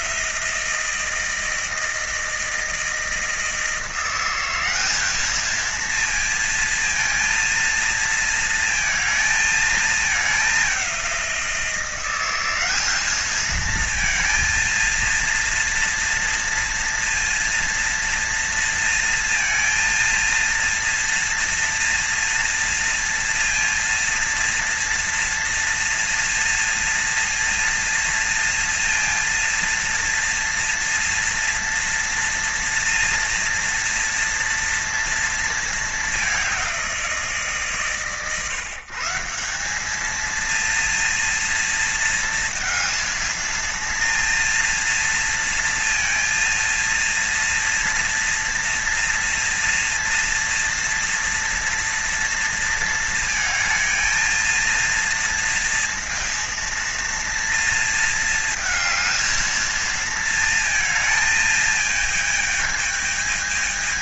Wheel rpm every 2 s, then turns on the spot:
170, 160, 190, 230, 230, 200, 200, 230, 230, 230, 230, 230, 230, 230, 230, 230, 240, 240, 190, 150, 230, 230, 230, 230, 230, 230, 230, 230, 230, 220, 230, 220.
none